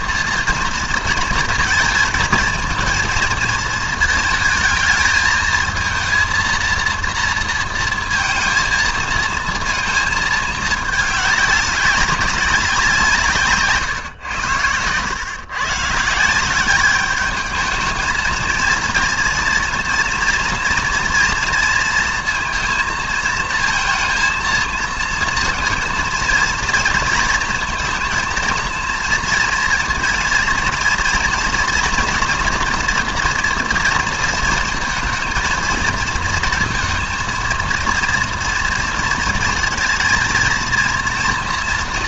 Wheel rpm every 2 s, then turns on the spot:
230, 220, 220, 230, 230, 210, 180, 100, 190, 230, 230, 230, 230, 230, 230, 230, 230, 230, 230, 230, 240.
none